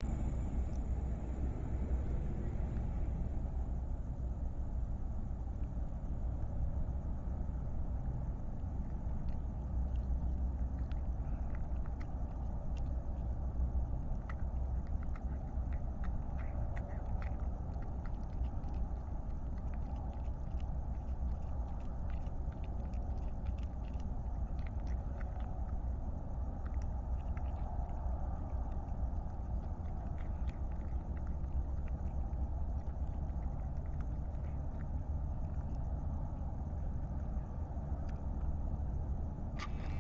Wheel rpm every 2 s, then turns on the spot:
0, 0, 0, 0, 0, 0, 0, 0, 0, 0, 0, 0, 0, 0, 0, 0, 0, 0, 0, 0.
none